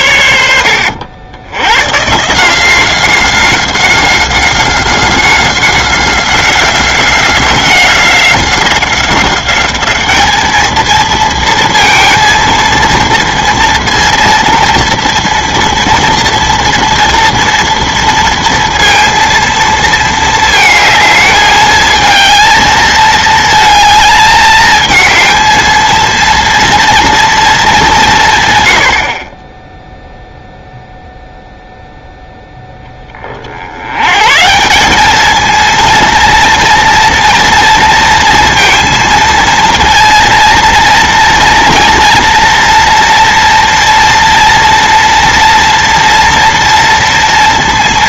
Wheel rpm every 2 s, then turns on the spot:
80, 180, 190, 180, 190, 220, 230, 240, 230, 230, 220, 220, 220, 230, 80, 0, 10, 180, 230, 230, 230, 230, 230, 230.
none